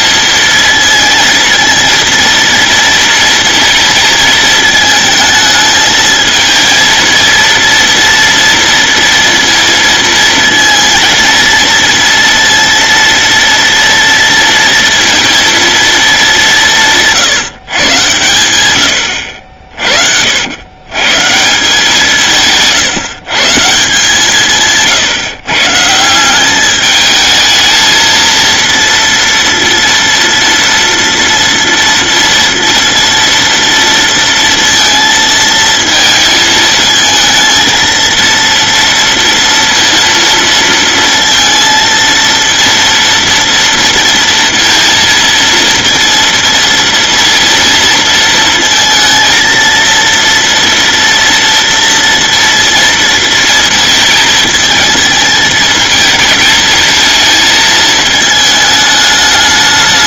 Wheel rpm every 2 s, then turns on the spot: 230, 230, 220, 230, 230, 230, 230, 230, 170, 100, 110, 150, 160, 200, 230, 230, 230, 230, 220, 230, 230, 230, 230, 230, 230, 230, 230, 220, 220, 210.
none